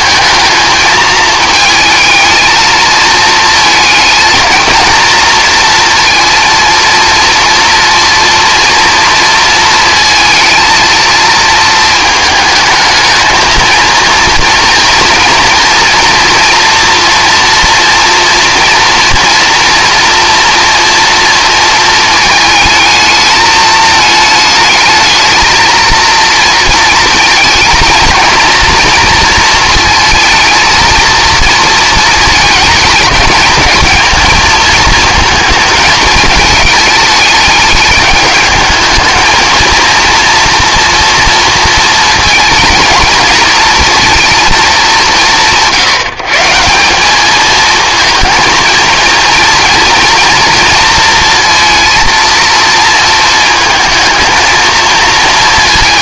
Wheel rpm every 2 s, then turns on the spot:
220, 220, 230, 230, 230, 230, 220, 230, 240, 230, 230, 220, 220, 230, 230, 220, 220, 220, 210, 220, 230, 220, 210, 170, 220, 230, 230, 230.
none